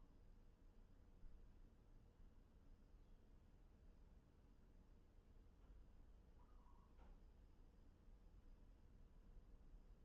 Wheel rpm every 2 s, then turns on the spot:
0, 0, 0, 0, 0.
none